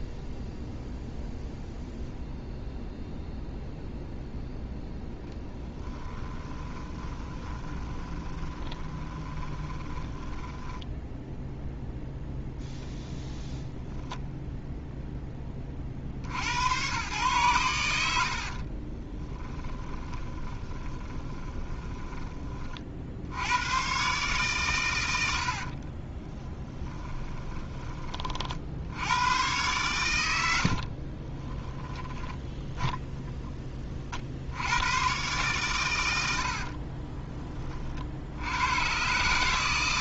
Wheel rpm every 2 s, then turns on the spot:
0, 0, 0, 20, 20, 10, 0, 0, 110, 40, 20, 40, 120, 30, 70, 60, 10, 100, 50, 110.
6-12 18-22 26-28 30-32 36-38